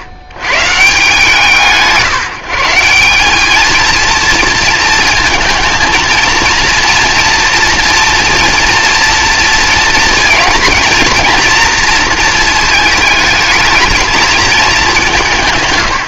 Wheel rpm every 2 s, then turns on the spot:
70, 160, 230, 230, 230, 230, 220, 220.
none